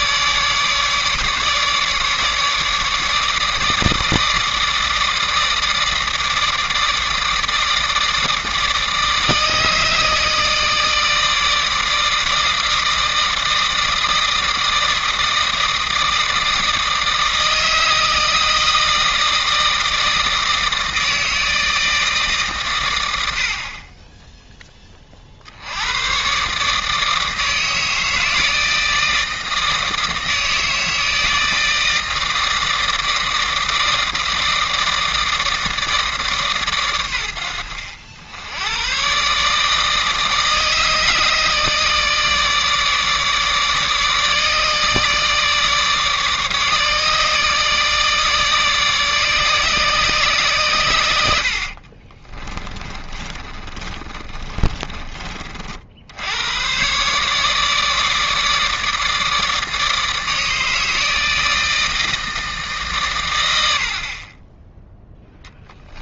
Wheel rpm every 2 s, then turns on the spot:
150, 150, 160, 160, 160, 160, 160, 160, 160, 160, 160, 130, 10, 150, 160, 160, 160, 160, 130, 100, 160, 150, 150, 150, 150, 110, 20, 30, 120, 160, 160, 150, 10.
52-56